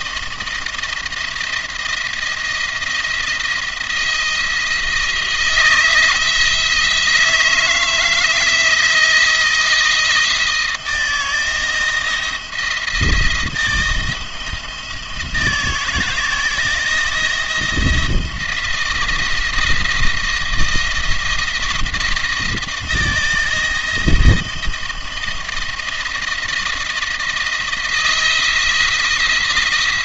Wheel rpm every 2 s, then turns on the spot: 170, 170, 160, 160, 160, 170, 170, 170, 160, 170, 160, 160, 160, 160, 170.
none